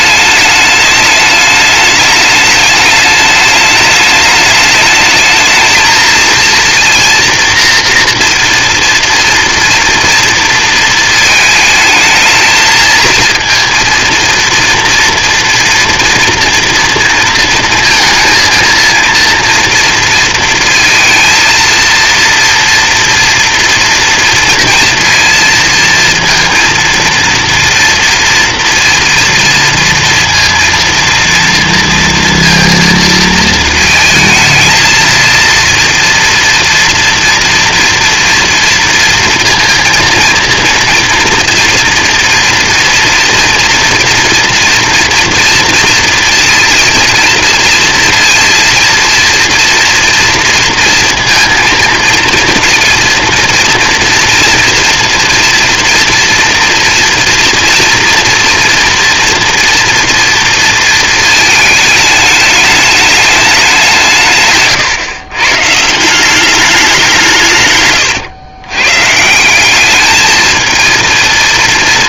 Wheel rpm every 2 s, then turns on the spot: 210, 210, 210, 230, 230, 230, 220, 230, 230, 230, 230, 230, 230, 230, 230, 230, 230, 220, 230, 230, 230, 230, 230, 230, 230, 240, 230, 230, 230, 240, 230, 210, 140, 190, 120, 220.
none